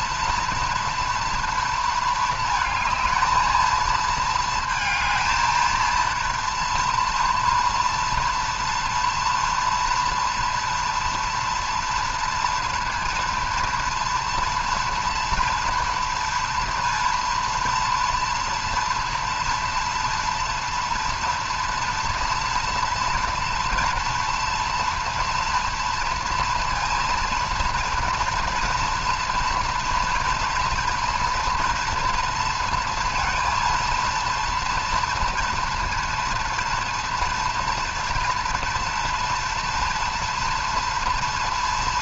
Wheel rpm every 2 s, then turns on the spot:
230, 220, 230, 230, 230, 230, 230, 230, 240, 230, 240, 240, 230, 230, 230, 230, 230, 230, 230, 230, 230.
none